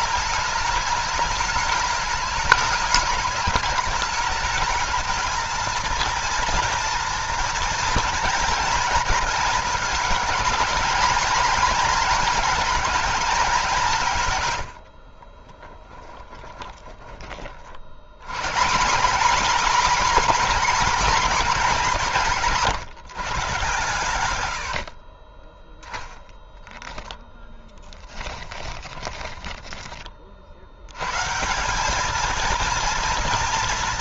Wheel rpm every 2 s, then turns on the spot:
220, 210, 220, 230, 230, 230, 220, 70, 20, 170, 240, 170, 70, 0, 10, 80, 230.
16-18 28-30